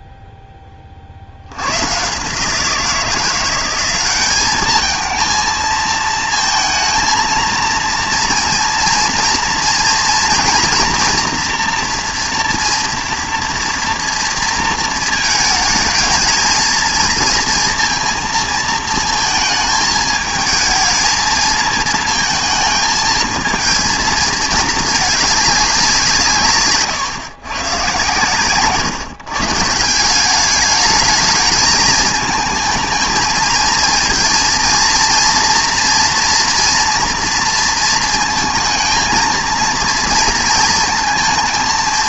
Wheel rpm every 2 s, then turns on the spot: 20, 160, 210, 230, 230, 240, 230, 230, 220, 230, 220, 220, 220, 140, 140, 200, 220, 230, 240, 220, 230.
none